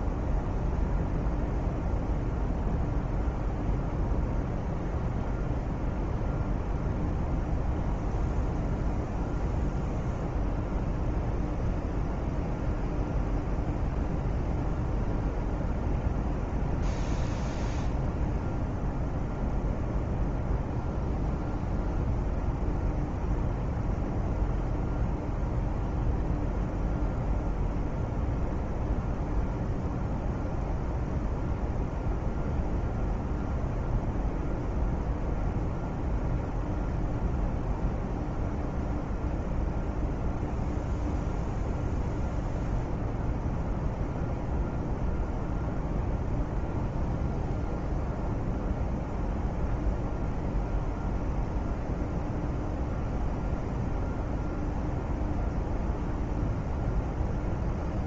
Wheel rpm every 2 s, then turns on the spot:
0, 0, 0, 0, 0, 0, 0, 0, 0, 0, 0, 0, 0, 0, 0, 0, 0, 0, 0, 0, 0, 0, 0, 0, 0, 0, 0, 0, 0.
none